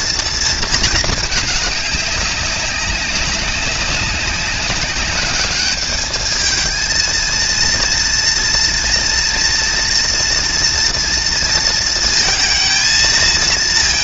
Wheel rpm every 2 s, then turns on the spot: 230, 200, 200, 220, 230, 230, 230.
none